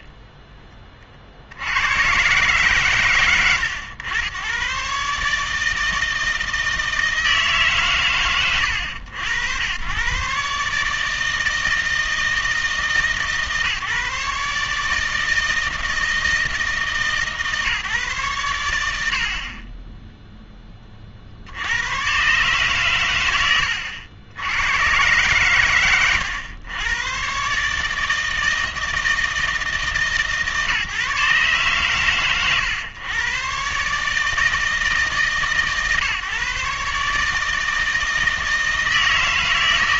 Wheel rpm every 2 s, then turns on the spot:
30, 120, 120, 160, 100, 140, 160, 150, 150, 90, 20, 130, 100, 100, 160, 140, 110, 160, 140, 160.
0-2